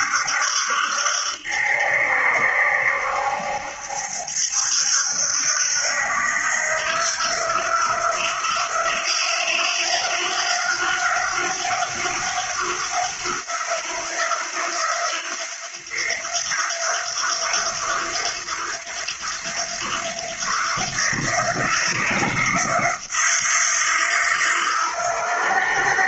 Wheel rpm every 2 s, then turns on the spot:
70, 70, 70, 80, 90, 90, 90, 90, 90, 90, 90, 90, 90.
none